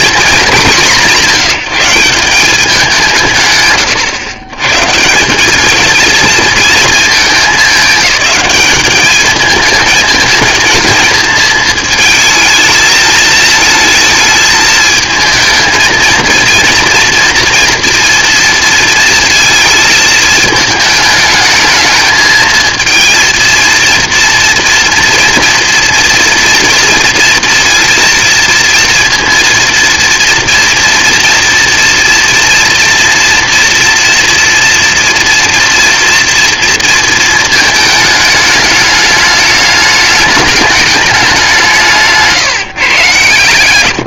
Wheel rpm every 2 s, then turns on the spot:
200, 190, 120, 230, 210, 230, 220, 220, 230, 230, 220, 220, 230, 230, 230, 230, 230, 230, 230, 210, 210, 140.
none